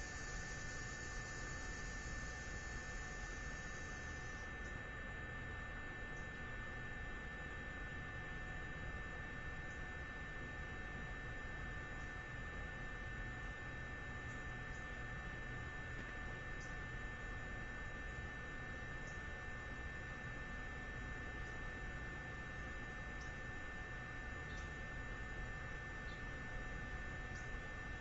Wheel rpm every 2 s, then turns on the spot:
0, 0, 0, 0, 0, 0, 0, 0, 0, 0, 0, 0, 0, 0.
none